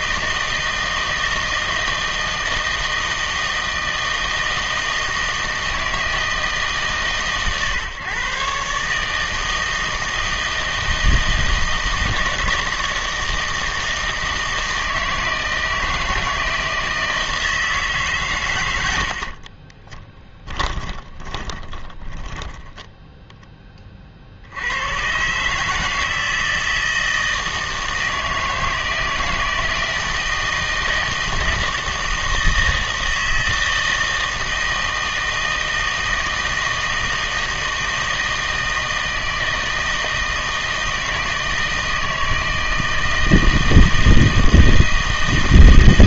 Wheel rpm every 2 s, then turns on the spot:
160, 160, 160, 150, 150, 160, 160, 160, 160, 80, 30, 10, 90, 160, 160, 160, 160, 160, 160, 160, 160, 160, 160.
20-24